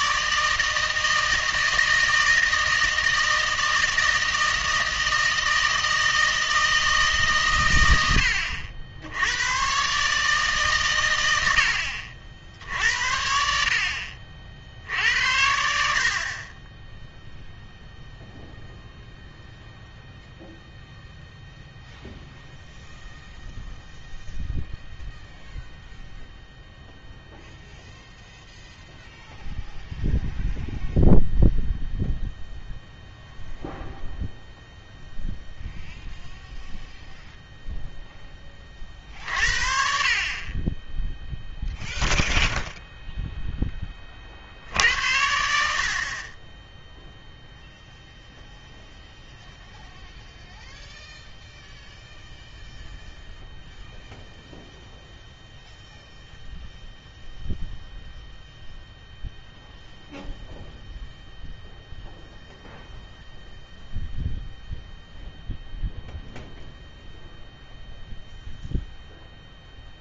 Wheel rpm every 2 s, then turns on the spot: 160, 160, 160, 160, 70, 130, 70, 70, 20, 0, 0, 0, 0, 0, 0, 0, 0, 0, 0, 30, 10, 0, 70, 10, 0, 0, 0, 0, 0, 0, 0, 0, 0, 0, 0.
none